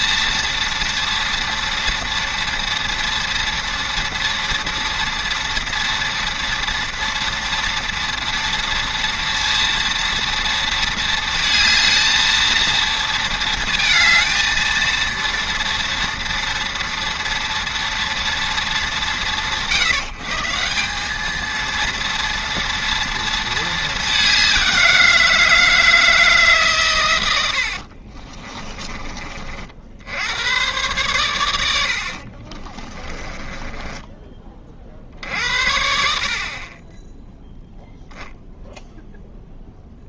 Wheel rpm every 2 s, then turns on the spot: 230, 230, 230, 230, 230, 230, 230, 230, 230, 210, 160, 230, 190, 150, 30, 100, 50, 20, 50, 0.
28-30 32-34